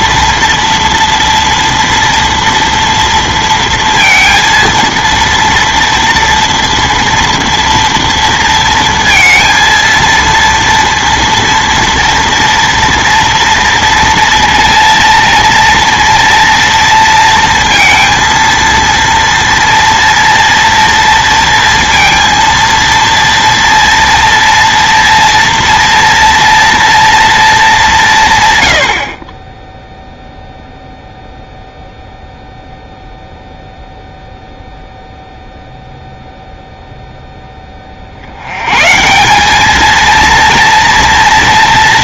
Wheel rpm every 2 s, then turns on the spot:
240, 230, 230, 240, 230, 230, 230, 230, 230, 230, 230, 230, 230, 230, 100, 0, 0, 0, 0, 110, 230.
none